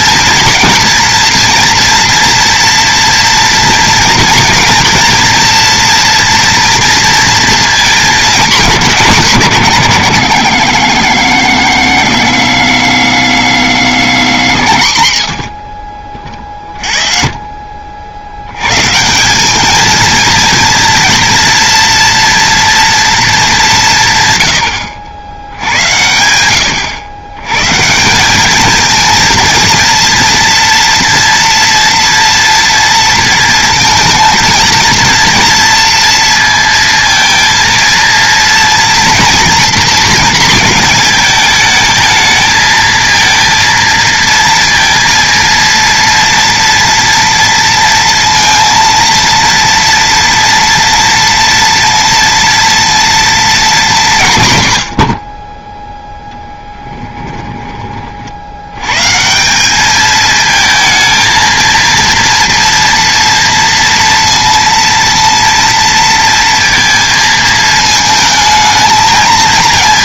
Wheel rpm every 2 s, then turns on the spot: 240, 230, 230, 230, 210, 100, 90, 80, 40, 120, 230, 230, 100, 90, 220, 230, 230, 230, 230, 230, 220, 220, 230, 230, 230, 230, 230, 120, 10, 100, 220, 230, 230, 230, 220.
56-58